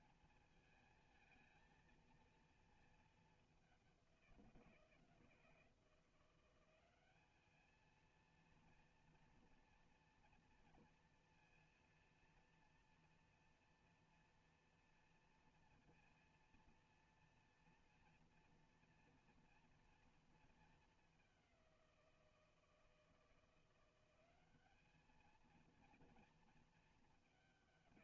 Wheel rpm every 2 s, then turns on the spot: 220, 230, 170, 180, 230, 230, 240, 240, 230, 240, 220, 170, 200, 230.
none